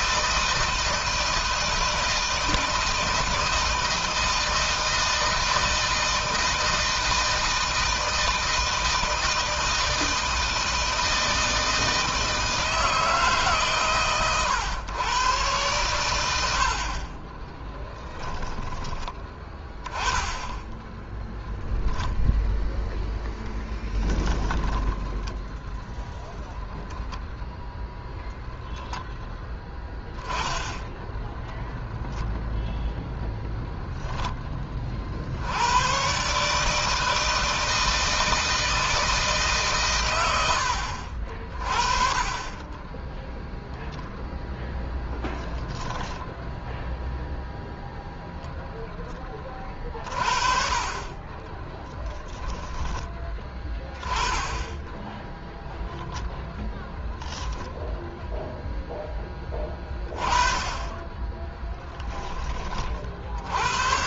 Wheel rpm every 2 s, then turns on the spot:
160, 160, 160, 160, 160, 160, 160, 120, 50, 10, 0, 0, 10, 0, 10, 20, 0, 30, 150, 160, 60, 20, 0, 0, 0, 30, 20, 10, 0, 10, 20, 30.
24-26